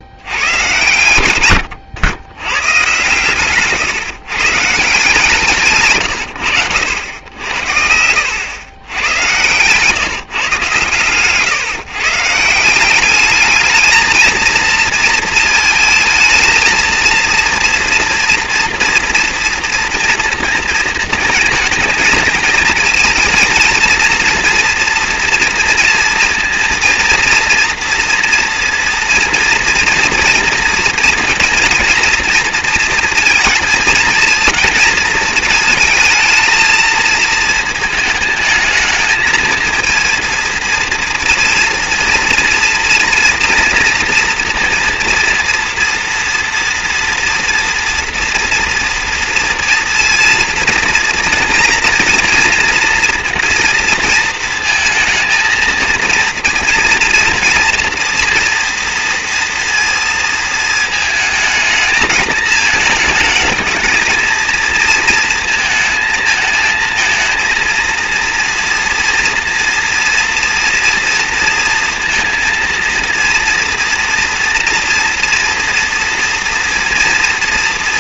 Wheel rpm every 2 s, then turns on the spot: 110, 120, 150, 80, 100, 120, 170, 230, 220, 230, 230, 230, 240, 230, 230, 230, 230, 220, 220, 210, 230, 230, 230, 230, 230, 240, 230, 230, 230, 240, 220, 220, 230, 230, 230, 230, 230, 230, 230.
none